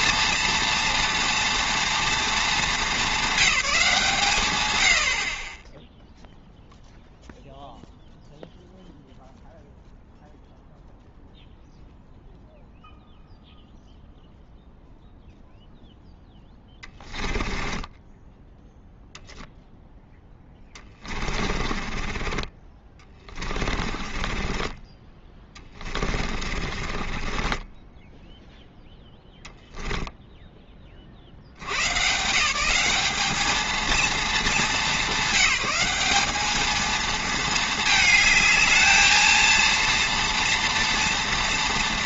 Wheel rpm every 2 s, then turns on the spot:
230, 210, 100, 0, 0, 0, 0, 0, 10, 10, 20, 20, 30, 40, 10, 10, 170, 210, 220, 220, 230.
16-18 20-28 30-32